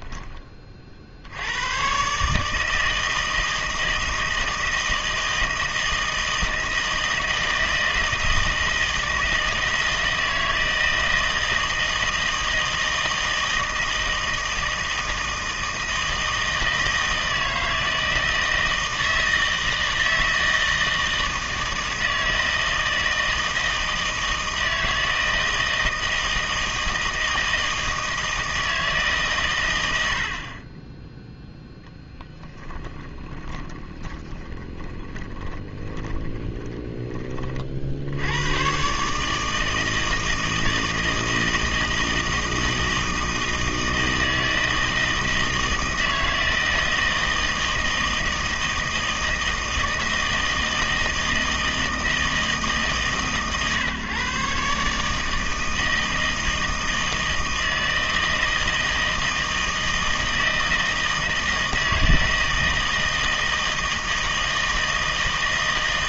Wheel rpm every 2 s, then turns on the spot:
30, 160, 160, 160, 160, 160, 160, 160, 160, 160, 160, 160, 160, 160, 160, 30, 20, 20, 10, 120, 160, 160, 160, 160, 160, 160, 150, 140, 160, 160, 160, 160, 160.
32-38